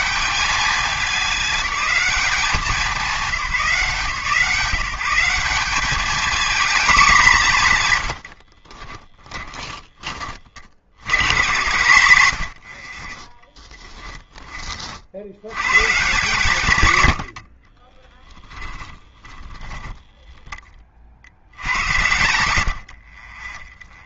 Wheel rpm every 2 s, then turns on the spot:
200, 190, 170, 230, 50, 80, 50, 50, 120, 10, 10, 70.
8-10 18-20 22-24